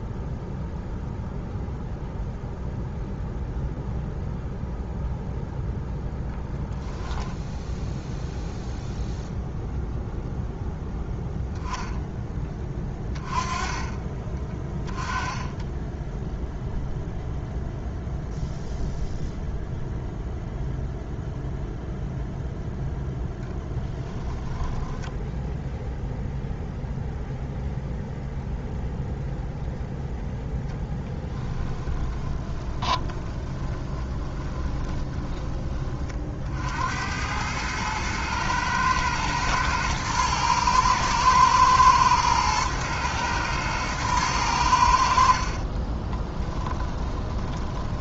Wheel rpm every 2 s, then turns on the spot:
0, 0, 0, 10, 0, 10, 20, 20, 0, 0, 0, 0, 10, 0, 0, 10, 20, 20, 80, 120, 110, 110, 80, 20.
6-8 14-16 24-26 30-36 44-48